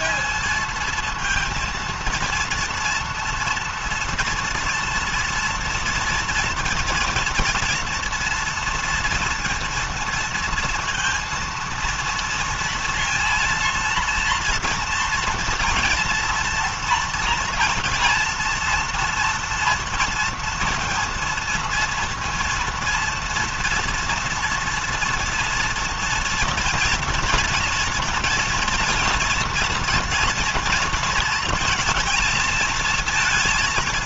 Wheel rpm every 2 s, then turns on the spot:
230, 230, 230, 230, 230, 230, 230, 230, 230, 230, 230, 230, 230, 230, 230, 230, 220.
none